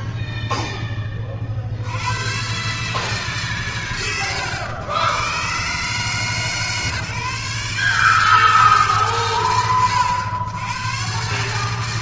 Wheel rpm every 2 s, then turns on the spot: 90, 100, 140, 140, 90, 140.
none